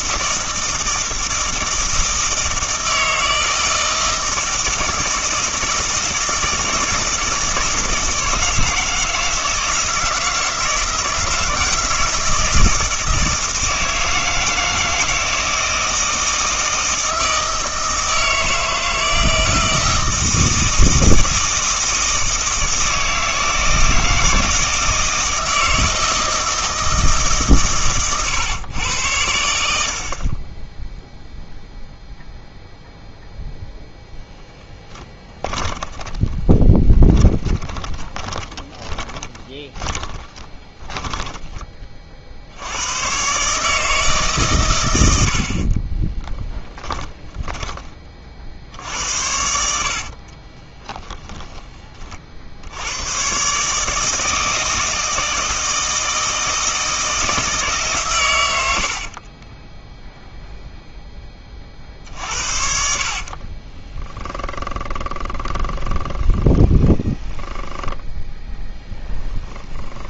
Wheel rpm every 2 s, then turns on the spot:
160, 160, 160, 160, 160, 160, 160, 160, 160, 160, 160, 160, 160, 160, 110, 10, 0, 10, 20, 20, 10, 100, 120, 20, 70, 20, 90, 160, 160, 70, 0, 60, 10, 20, 0.
36-42 46-48 50-52 58-60 62-68